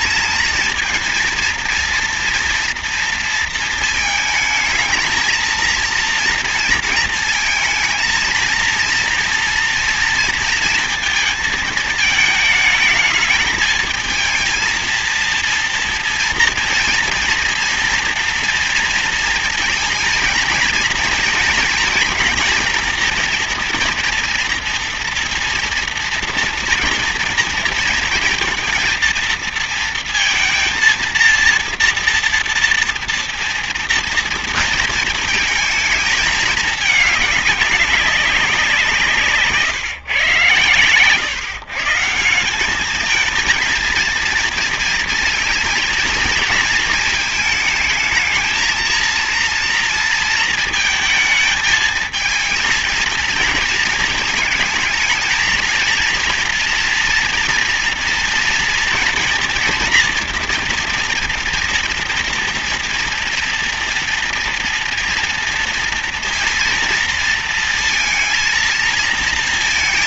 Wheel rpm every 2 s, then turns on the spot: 230, 230, 220, 230, 230, 230, 220, 230, 230, 230, 230, 230, 230, 230, 230, 230, 230, 230, 210, 170, 120, 200, 230, 220, 220, 220, 230, 220, 240, 230, 230, 230, 230, 230, 230.
none